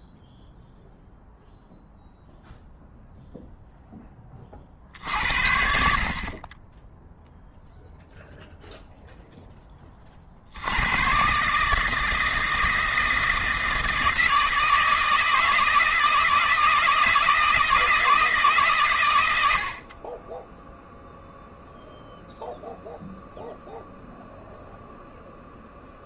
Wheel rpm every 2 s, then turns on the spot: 0, 0, 50, 20, 0, 110, 160, 160, 160, 120, 0, 0, 0.
none